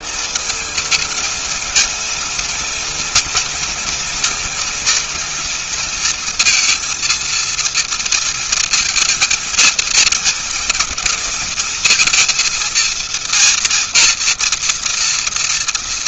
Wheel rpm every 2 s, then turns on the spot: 220, 230, 230, 230, 230, 220, 230, 230.
none